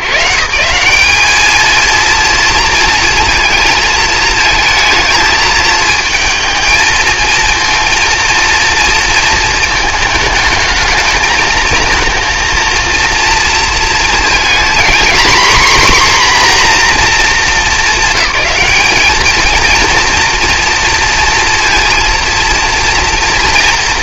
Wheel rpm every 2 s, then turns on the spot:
160, 230, 220, 220, 230, 220, 230, 240, 250, 210, 230, 230.
none